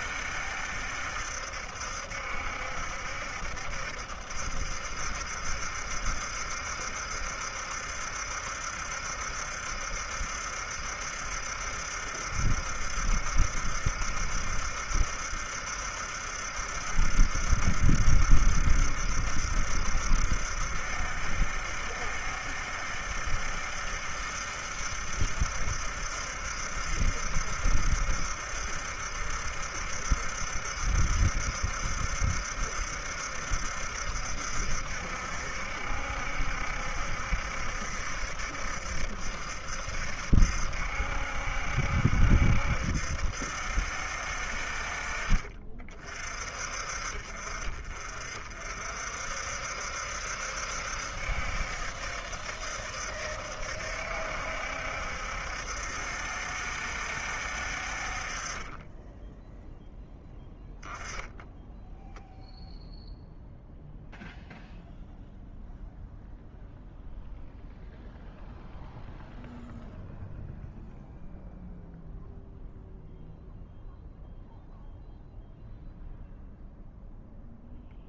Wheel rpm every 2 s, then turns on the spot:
70, 70, 70, 70, 70, 70, 70, 70, 70, 70, 70, 70, 70, 70, 70, 70, 70, 70, 70, 70, 70, 70, 50, 50, 60, 70, 70, 70, 70, 10, 10, 0, 0, 0, 0, 0, 0, 0, 0.
58-60